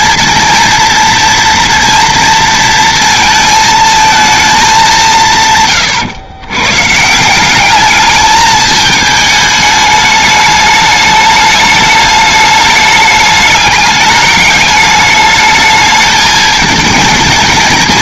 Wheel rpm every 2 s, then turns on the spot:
240, 220, 160, 180, 210, 210, 210, 210, 220.
none